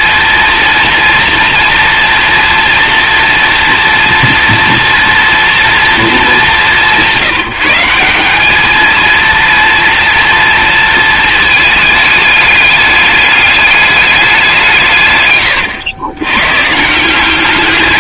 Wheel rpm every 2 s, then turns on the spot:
240, 230, 230, 190, 220, 230, 210, 150, 140.
none